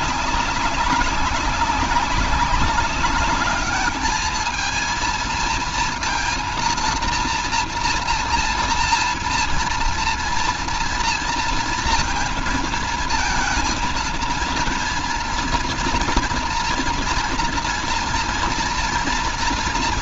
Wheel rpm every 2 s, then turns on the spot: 200, 190, 220, 230, 230, 230, 230, 230, 230, 230.
none